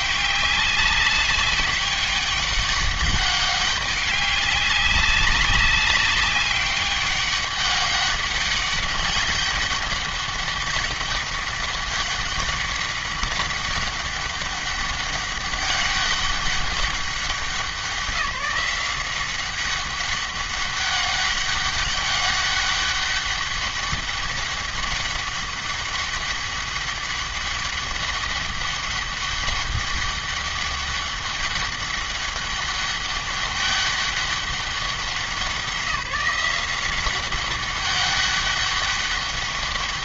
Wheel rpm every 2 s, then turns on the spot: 200, 200, 200, 200, 200, 200, 200, 200, 200, 180, 200, 200, 200, 200, 200, 200, 200, 190, 180, 200.
none